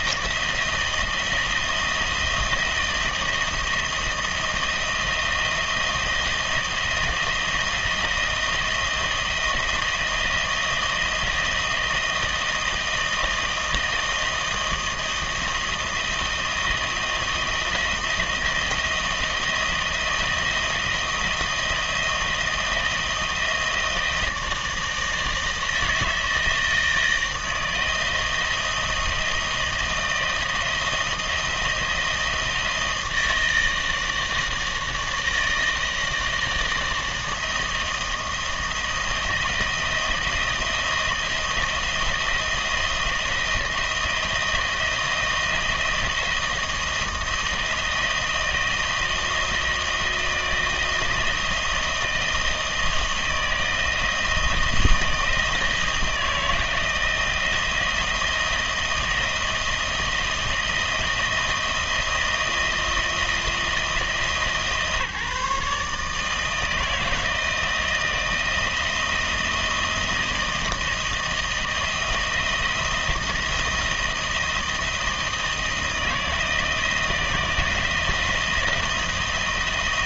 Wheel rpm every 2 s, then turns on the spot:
170, 160, 160, 160, 160, 160, 160, 160, 160, 170, 170, 160, 160, 160, 160, 160, 160, 160, 160, 160, 170, 160, 160, 160, 170, 160, 160, 160, 160, 170, 160, 160, 150, 160, 160, 160, 170, 160, 160, 160.
none